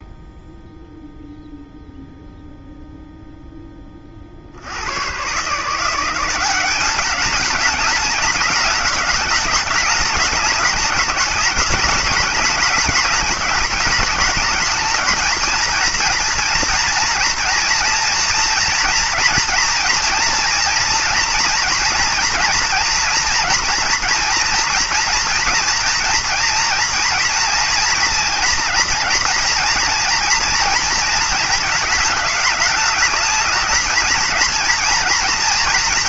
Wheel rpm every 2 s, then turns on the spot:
0, 0, 50, 190, 210, 210, 210, 210, 230, 230, 230, 230, 230, 230, 240, 230, 210, 230.
none